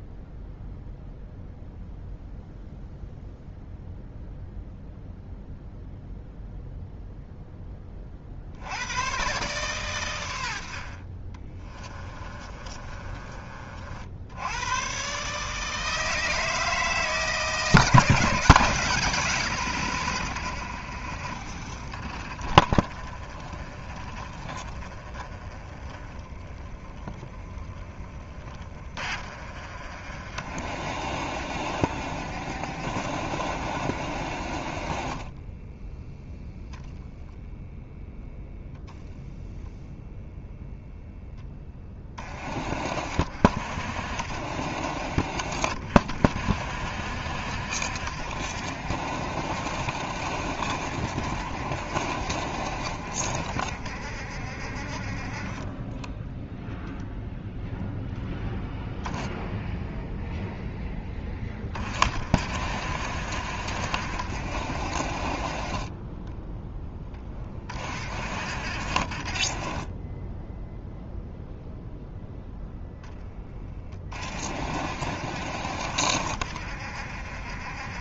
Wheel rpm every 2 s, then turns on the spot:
0, 0, 0, 0, 90, 50, 30, 120, 160, 160, 70, 40, 30, 30, 40, 50, 60, 40, 0, 0, 0, 50, 60, 60, 60, 60, 60, 50, 0, 10, 10, 60, 50, 10, 50, 0, 10, 50, 60.
12-14 22-28 68-70